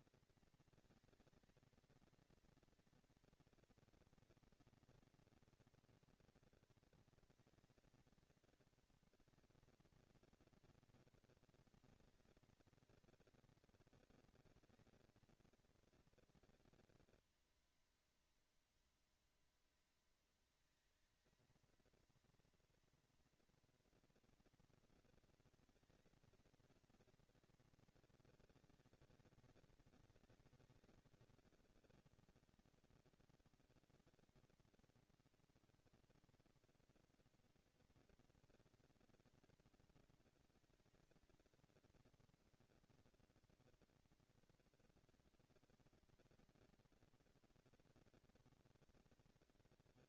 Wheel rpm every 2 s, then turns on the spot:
230, 230, 230, 230, 240, 230, 230, 230, 230, 230, 230, 230, 230, 230, 200, 200, 230, 230, 240, 230, 230, 230, 240, 240, 230.
none